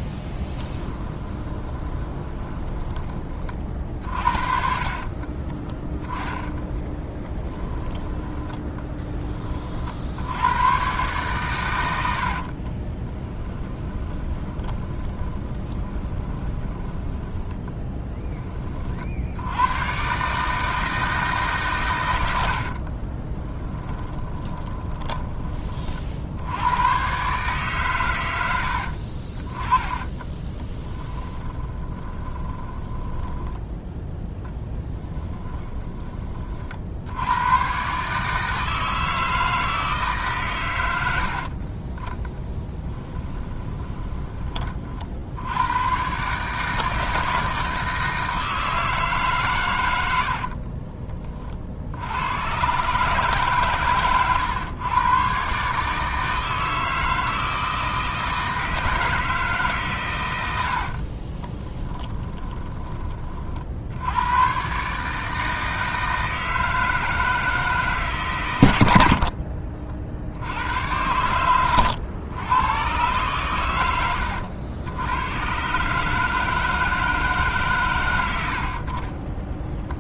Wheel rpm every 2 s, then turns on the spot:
10, 20, 40, 30, 10, 110, 30, 30, 20, 40, 160, 50, 20, 100, 70, 20, 20, 10, 60, 160, 110, 10, 40, 160, 160, 30, 130, 110, 160, 160, 70, 10, 140, 160, 110, 90, 110, 90, 160, 40.
0-2 4-10 12-18 22-26 30-36 42-44 50-52 60-64